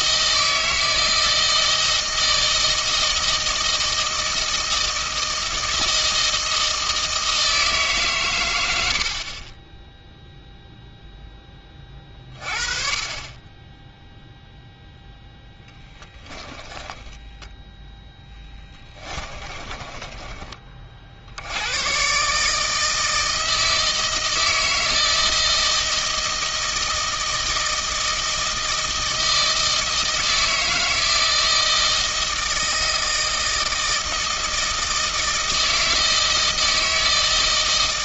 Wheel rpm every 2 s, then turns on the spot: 160, 160, 160, 160, 70, 0, 30, 0, 20, 20, 50, 160, 160, 160, 160, 160, 160, 160, 160.
16-20